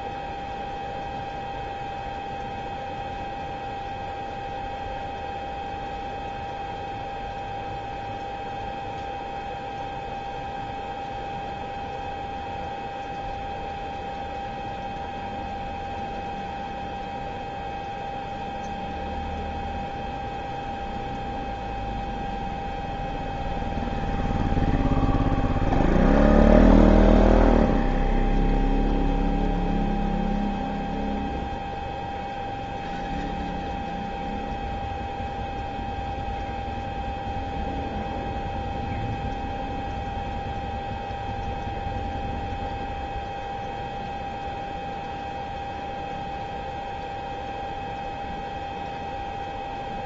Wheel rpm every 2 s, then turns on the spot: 0, 0, 0, 0, 0, 0, 0, 0, 0, 0, 0, 0, 0, 0, 0, 0, 0, 0, 0, 0, 0, 0, 0, 0, 0.
none